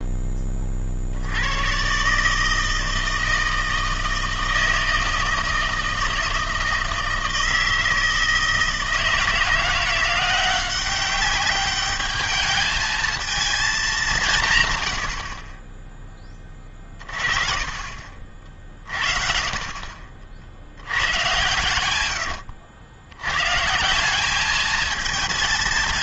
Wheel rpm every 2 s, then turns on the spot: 30, 160, 160, 160, 160, 180, 210, 130, 30, 40, 80, 80, 220.
14-16 18-20